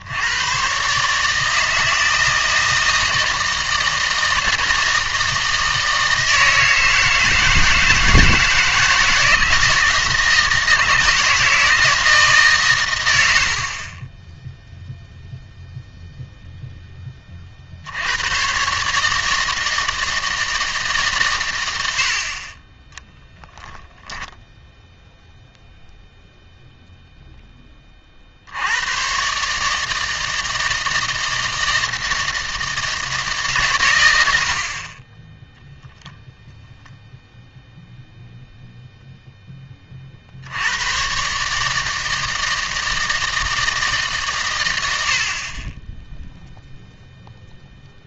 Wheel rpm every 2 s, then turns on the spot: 120, 160, 160, 160, 160, 160, 140, 0, 0, 130, 160, 20, 0, 0, 80, 160, 160, 60, 0, 0, 90, 160, 100, 0.
none